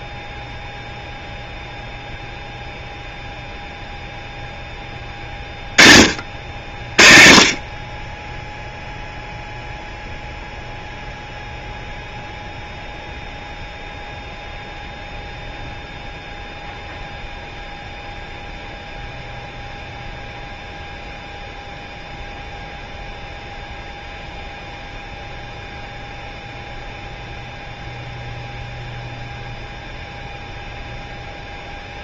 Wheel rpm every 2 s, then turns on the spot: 0, 0, 20, 50, 0, 0, 0, 0, 0, 0, 0, 0, 0, 0, 0, 0.
none